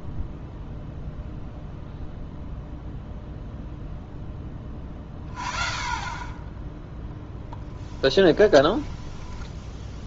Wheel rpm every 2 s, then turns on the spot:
0, 0, 20, 10, 10.
8-10